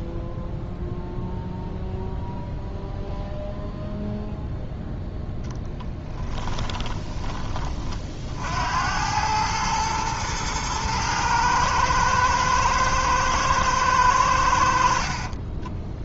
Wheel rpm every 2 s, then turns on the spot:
0, 0, 0, 10, 70, 110, 110, 70.
6-8